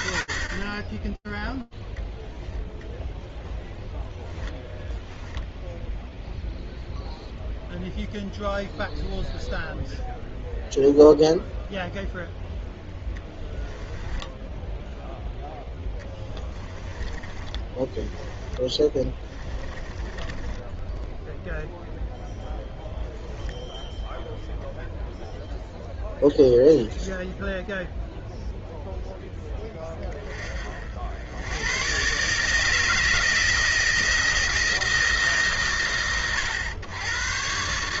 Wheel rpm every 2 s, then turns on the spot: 10, 10, 0, 0, 0, 0, 10, 10, 10, 10, 10, 10, 0, 0, 20, 120, 160, 110, 150.
12-20